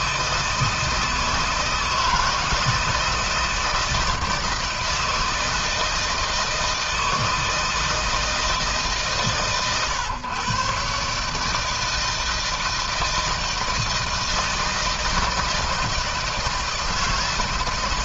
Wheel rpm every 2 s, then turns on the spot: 160, 160, 160, 160, 150, 140, 160, 160, 160.
none